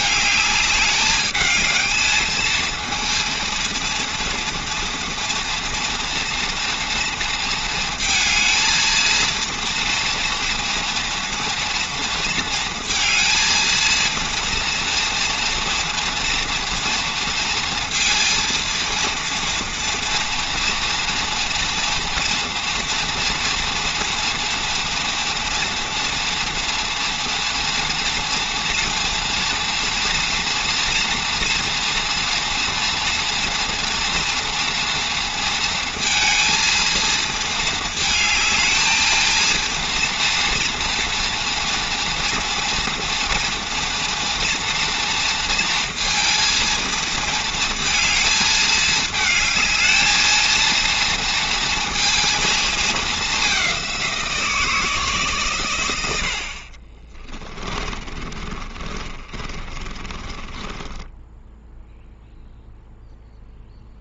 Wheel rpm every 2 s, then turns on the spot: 220, 220, 230, 230, 230, 240, 230, 230, 230, 230, 230, 230, 230, 230, 230, 240, 230, 230, 230, 220, 230, 230, 230, 230, 220, 230, 220, 160, 50, 30, 10, 0.
58-62